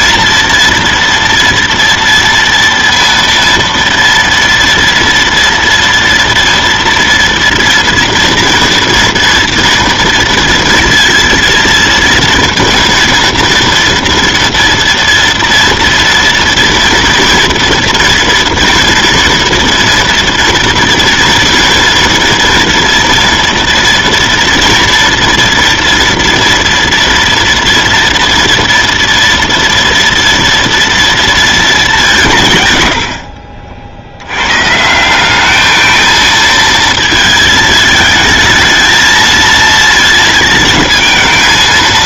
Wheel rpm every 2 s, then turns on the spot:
230, 230, 230, 230, 230, 230, 230, 240, 230, 230, 230, 230, 230, 230, 230, 230, 40, 190, 220, 220, 220.
32-34